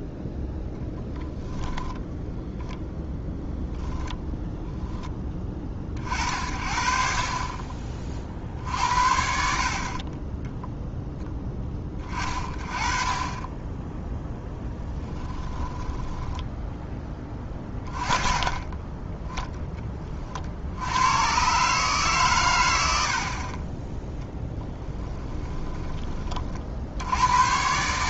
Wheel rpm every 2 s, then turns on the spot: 10, 10, 10, 40, 60, 0, 30, 10, 10, 20, 80, 80, 10, 60.
0-2 14-16 24-26